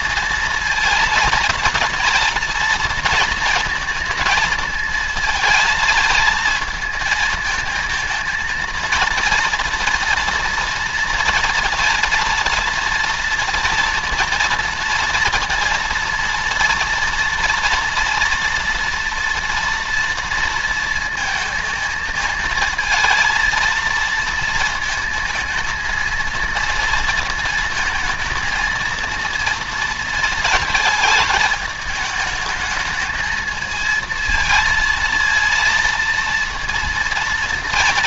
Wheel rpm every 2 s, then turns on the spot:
220, 230, 220, 220, 220, 230, 230, 230, 230, 230, 230, 220, 230, 230, 230, 220, 210, 230, 230.
none